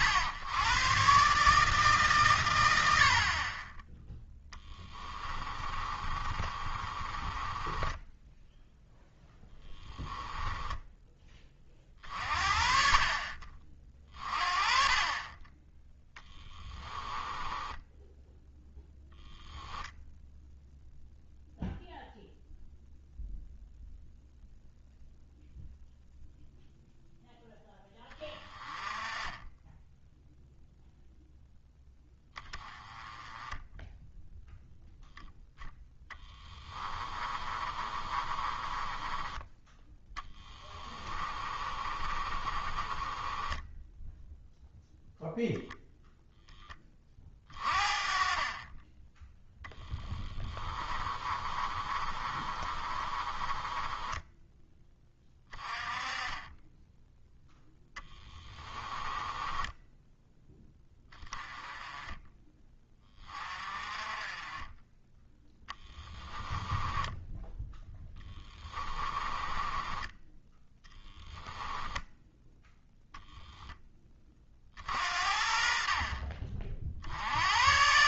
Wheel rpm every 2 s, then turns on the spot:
120, 80, 10, 30, 0, 10, 40, 30, 10, 0, 0, 0, 0, 0, 20, 0, 10, 10, 20, 20, 20, 20, 0, 20, 20, 20, 30, 10, 10, 20, 10, 20, 10, 10, 20, 10, 0, 60, 50.
4-8 16-18 36-44 50-54 58-60 66-72